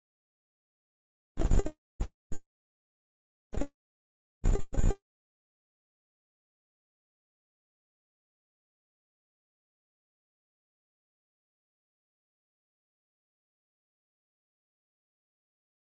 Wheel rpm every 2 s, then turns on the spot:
0, 0, 0, 0, 0, 0, 0, 0.
none